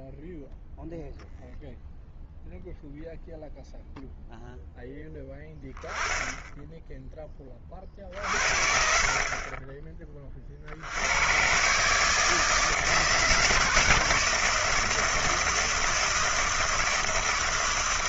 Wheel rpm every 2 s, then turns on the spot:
0, 0, 10, 30, 20, 130, 150, 160, 160.
none